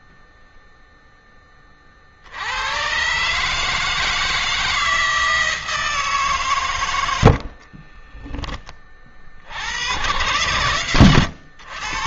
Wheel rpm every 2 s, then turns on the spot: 0, 90, 160, 120, 20, 110.
10-12